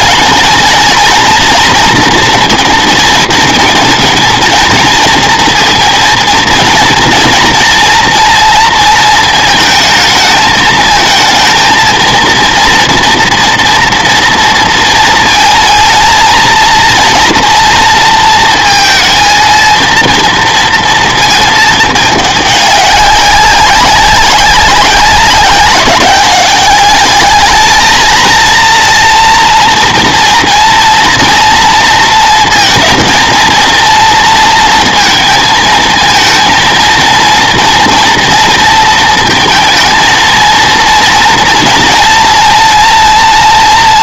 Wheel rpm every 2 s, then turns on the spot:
240, 230, 230, 230, 230, 220, 230, 230, 230, 230, 230, 200, 190, 200, 230, 230, 230, 230, 230, 230, 230, 230.
none